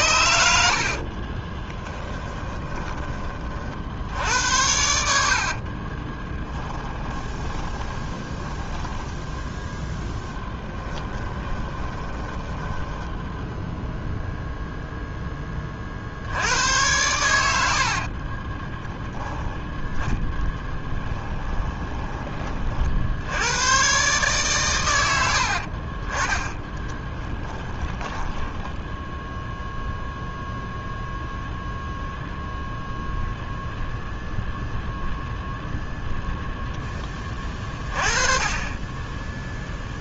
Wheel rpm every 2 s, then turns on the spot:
60, 20, 70, 20, 10, 20, 10, 0, 100, 20, 10, 50, 110, 10, 10, 0, 0, 0, 10, 20.
0-2 6-14 18-22 26-30